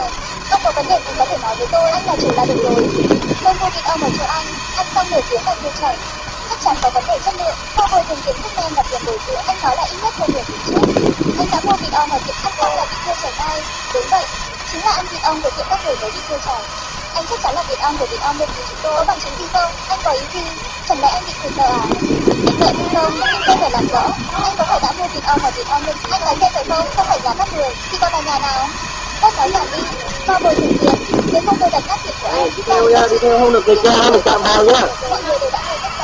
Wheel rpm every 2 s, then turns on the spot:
160, 160, 160, 160, 160, 160, 160, 170, 160, 160, 160, 160, 160, 160, 160, 160, 160, 170.
none